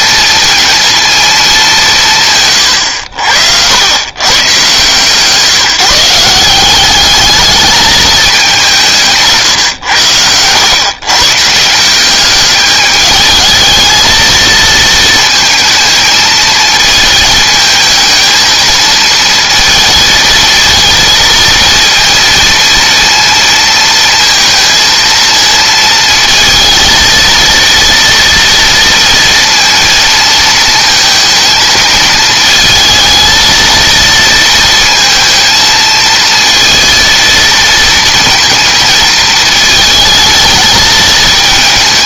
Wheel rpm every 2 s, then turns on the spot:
230, 90, 140, 190, 170, 120, 210, 220, 220, 220, 230, 230, 230, 230, 230, 220, 220, 230, 230, 230, 220.
none